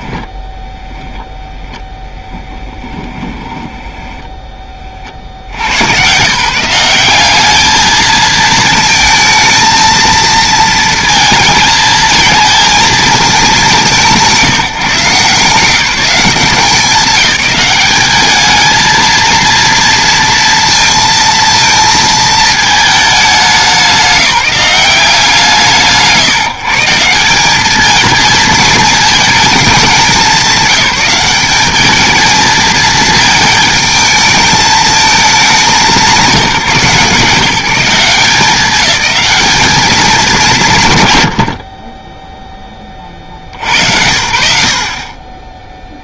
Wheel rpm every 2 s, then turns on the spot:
10, 10, 20, 180, 220, 220, 230, 170, 180, 220, 230, 220, 180, 150, 220, 200, 220, 220, 170, 200, 160, 20, 80.
2-4